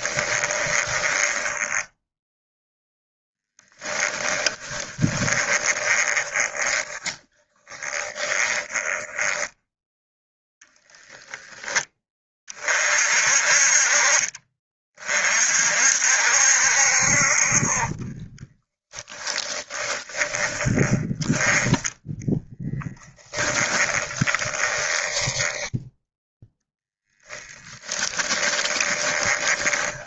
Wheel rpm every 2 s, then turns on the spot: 20, 10, 30, 20, 10, 0, 40, 40, 60, 10, 10, 20, 20, 0, 20.
0-10 18-26 28-30